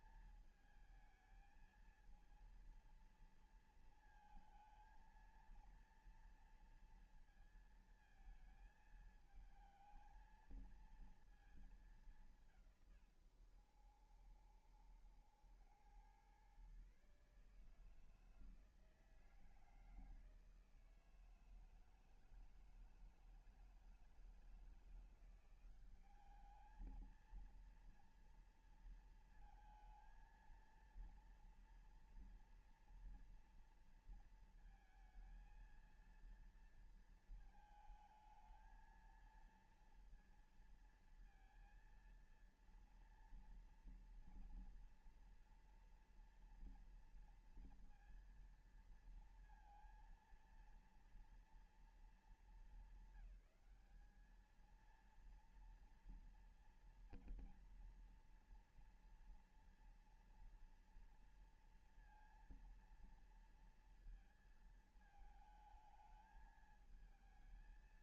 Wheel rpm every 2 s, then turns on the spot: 220, 230, 220, 230, 220, 220, 120, 80, 140, 160, 160, 160, 170, 220, 230, 230, 230, 230, 230, 220, 230, 230, 230, 230, 230, 230, 200, 220, 230, 230, 230, 230, 220, 220.
none